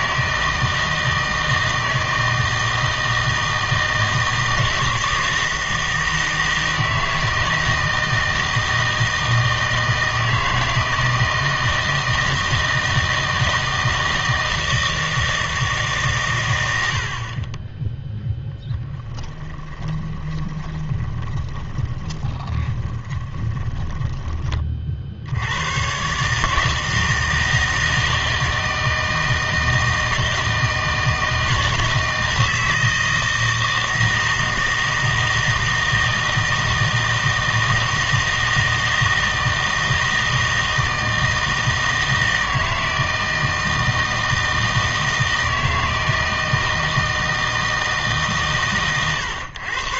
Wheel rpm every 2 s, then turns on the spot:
160, 160, 160, 160, 160, 160, 160, 160, 90, 10, 20, 20, 30, 160, 160, 160, 160, 160, 160, 160, 160, 160, 160, 160, 120.
18-24